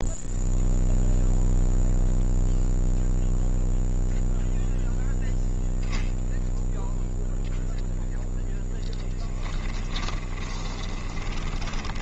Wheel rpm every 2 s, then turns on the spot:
0, 0, 0, 0, 10, 20.
10-12